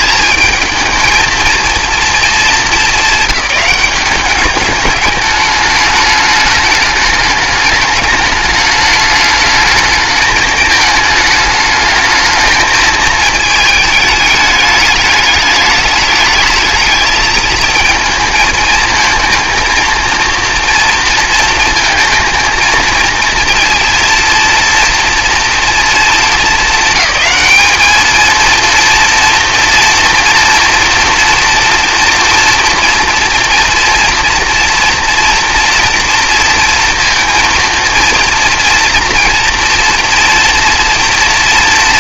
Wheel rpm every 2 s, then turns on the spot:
220, 200, 200, 210, 210, 210, 220, 210, 210, 220, 230, 220, 230, 200, 230, 230, 230, 230, 230, 230, 240.
none